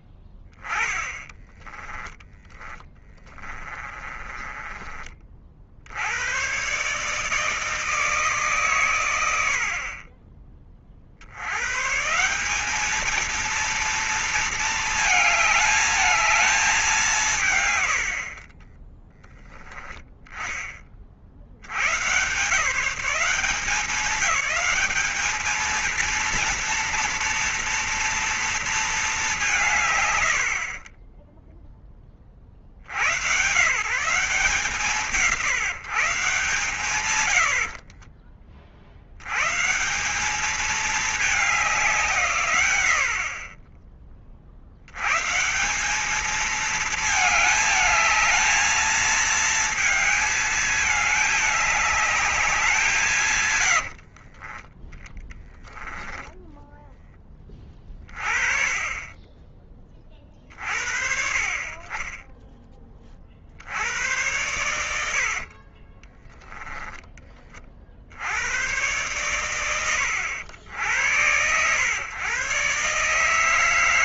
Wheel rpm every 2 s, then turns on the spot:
10, 20, 30, 140, 110, 50, 210, 220, 200, 30, 30, 140, 200, 230, 220, 40, 90, 160, 120, 70, 210, 70, 130, 220, 220, 220, 170, 20, 10, 20, 40, 30, 70, 20, 110, 90, 140.
0-4 18-20 36-38 58-60 64-66